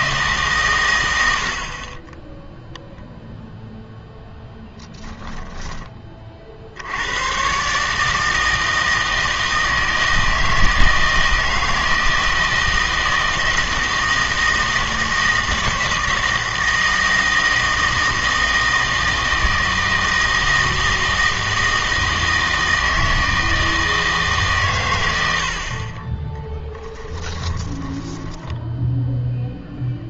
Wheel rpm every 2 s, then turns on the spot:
80, 0, 10, 100, 160, 160, 160, 160, 160, 160, 160, 160, 80, 10, 0.
4-6 26-28